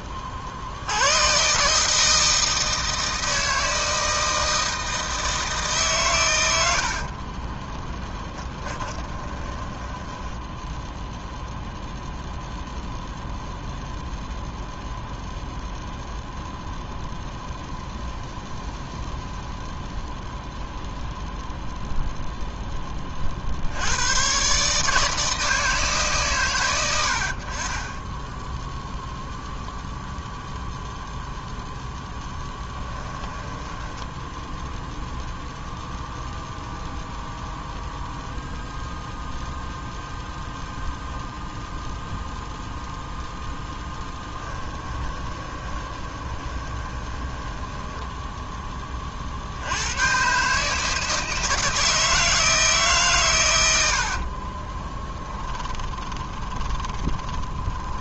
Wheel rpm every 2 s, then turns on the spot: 40, 160, 160, 80, 20, 10, 0, 0, 0, 0, 0, 0, 140, 120, 10, 0, 10, 0, 0, 0, 0, 0, 10, 20, 10, 140, 160, 40, 20.
8-12 32-34 44-48 54-58